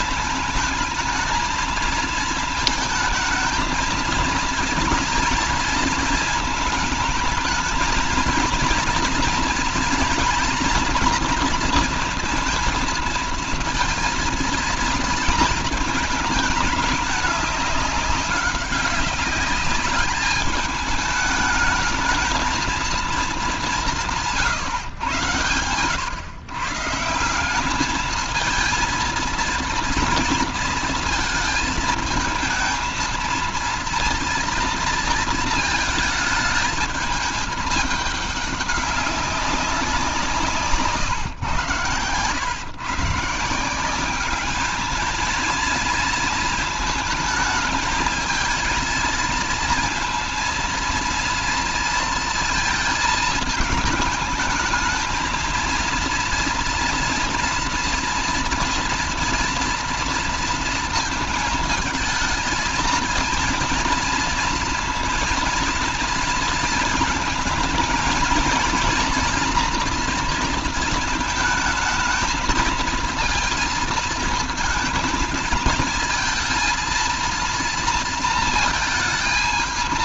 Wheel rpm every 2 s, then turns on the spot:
220, 220, 230, 220, 230, 240, 230, 230, 210, 200, 210, 220, 130, 150, 230, 230, 220, 230, 220, 200, 150, 130, 210, 220, 220, 230, 230, 220, 230, 240, 230, 230, 230, 220, 230, 230, 220, 220, 220, 230.
none